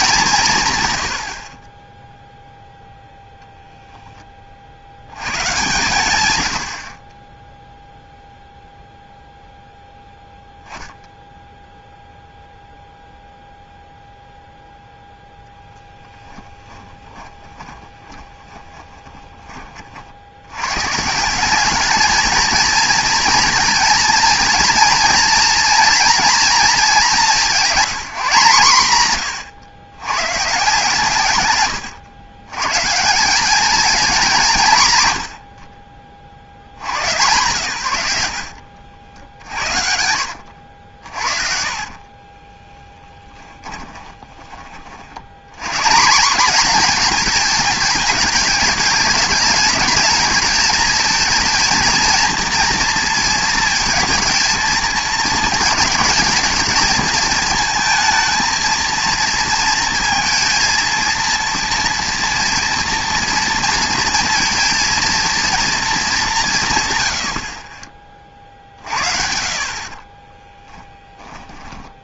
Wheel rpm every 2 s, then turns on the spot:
140, 0, 60, 80, 0, 0, 0, 0, 10, 10, 110, 230, 230, 230, 160, 160, 130, 160, 80, 70, 60, 20, 30, 230, 210, 220, 230, 220, 220, 230, 230, 230, 230, 140, 50, 10.
16-20 38-40 42-44